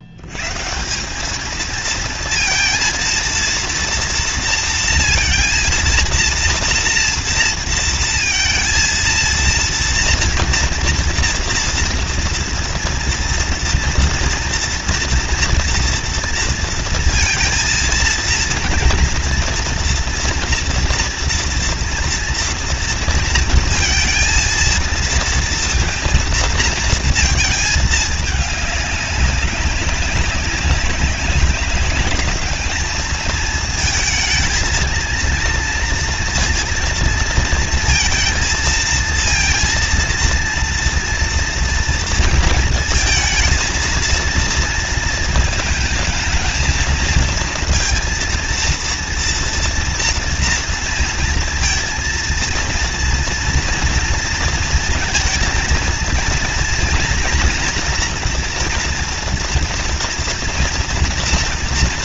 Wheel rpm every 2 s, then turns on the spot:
200, 230, 230, 230, 230, 240, 230, 240, 230, 230, 230, 230, 230, 220, 200, 200, 220, 230, 230, 230, 230, 230, 230, 230, 230, 230, 240, 230, 230, 230, 230.
none